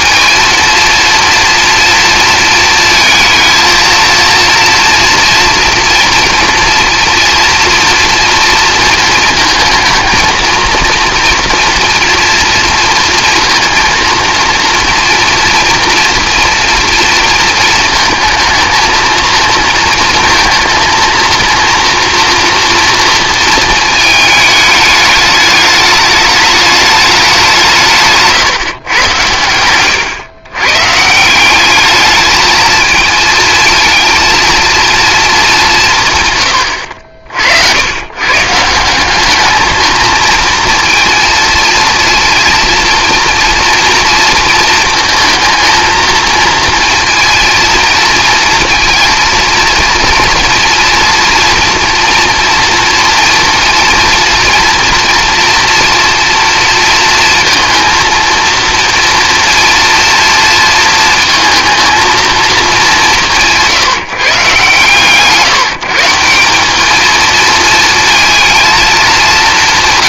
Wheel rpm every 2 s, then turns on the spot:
230, 230, 230, 230, 230, 230, 230, 230, 230, 230, 230, 230, 210, 210, 130, 140, 220, 230, 80, 180, 230, 230, 230, 230, 230, 230, 230, 240, 230, 240, 230, 200, 140, 200, 220.
none